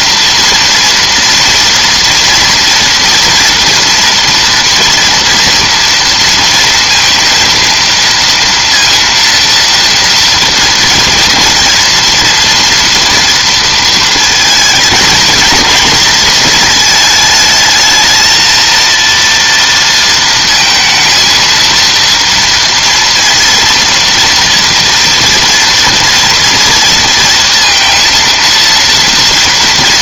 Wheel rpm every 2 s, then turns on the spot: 230, 230, 240, 230, 230, 230, 240, 230, 220, 230, 230, 230, 230, 230, 230.
none